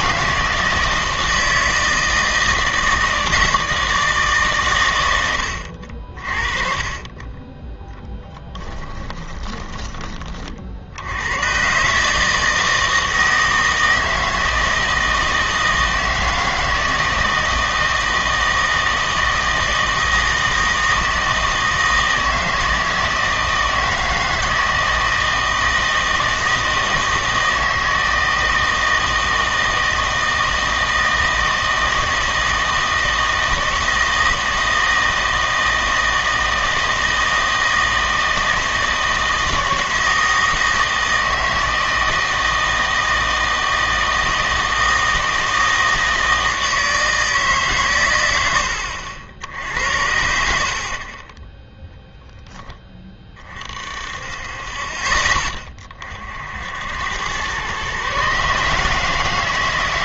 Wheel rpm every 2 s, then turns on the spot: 160, 160, 130, 30, 10, 50, 160, 160, 160, 160, 160, 160, 160, 160, 160, 160, 160, 160, 160, 160, 160, 160, 160, 160, 90, 60, 10, 30, 70, 150.
8-10 50-52